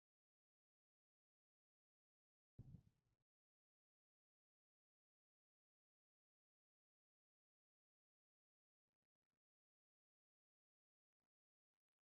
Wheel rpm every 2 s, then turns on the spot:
0, 0, 0, 0, 0, 0.
none